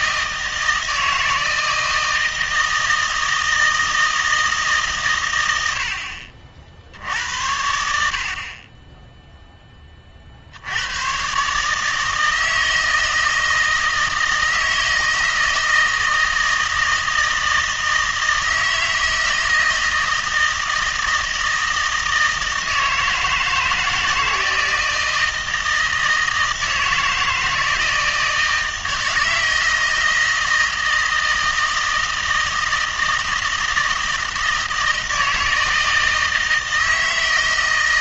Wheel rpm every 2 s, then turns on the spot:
160, 160, 150, 70, 20, 90, 160, 160, 160, 160, 160, 160, 160, 160, 160, 160, 160, 160, 160.
none